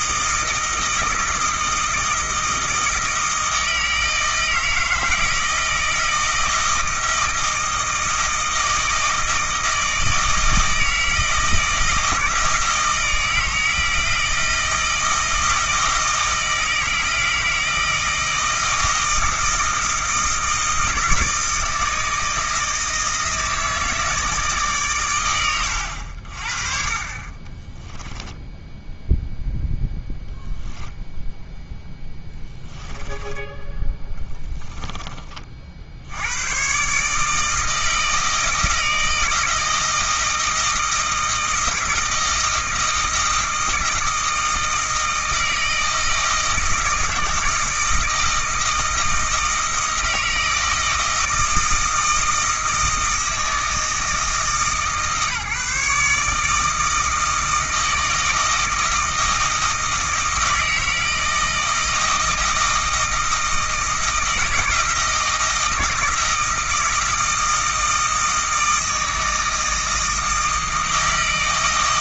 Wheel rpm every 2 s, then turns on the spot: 160, 160, 160, 160, 160, 160, 160, 160, 160, 160, 160, 160, 140, 40, 0, 0, 10, 10, 120, 160, 160, 170, 160, 160, 160, 160, 160, 150, 160, 160, 160, 160, 160, 160, 160, 160.
32-36